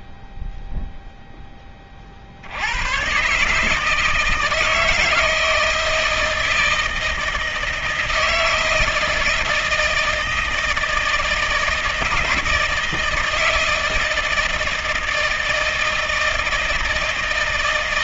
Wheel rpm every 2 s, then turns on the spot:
0, 60, 160, 160, 160, 160, 160, 160, 160.
none